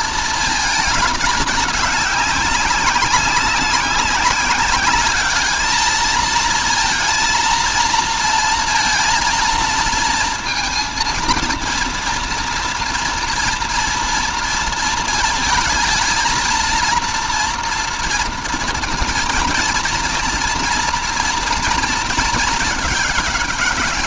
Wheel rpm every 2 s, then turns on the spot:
220, 190, 200, 230, 230, 230, 230, 230, 230, 230, 240, 210.
none